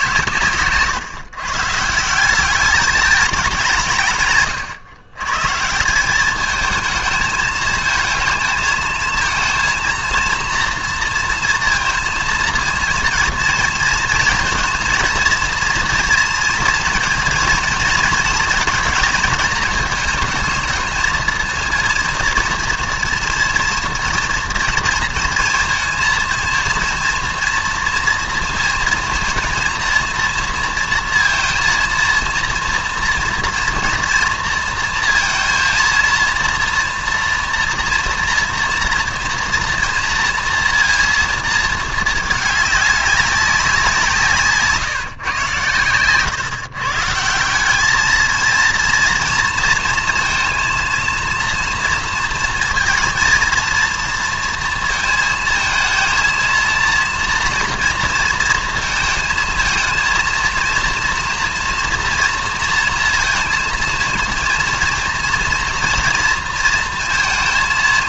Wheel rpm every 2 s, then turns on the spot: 130, 210, 120, 220, 220, 230, 230, 230, 230, 230, 220, 230, 240, 230, 220, 230, 230, 230, 230, 230, 230, 210, 150, 130, 230, 230, 230, 230, 230, 230, 230, 230, 230, 230.
none